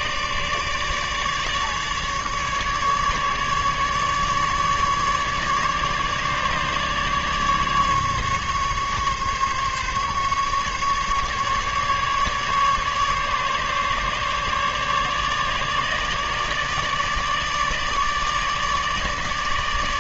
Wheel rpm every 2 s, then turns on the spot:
150, 150, 150, 150, 150, 150, 140, 150, 150, 150.
none